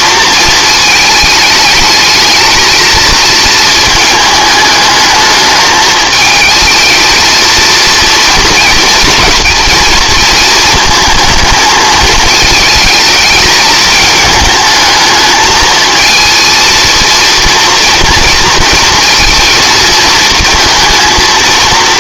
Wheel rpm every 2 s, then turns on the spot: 220, 220, 210, 220, 220, 230, 220, 220, 230, 230, 230.
none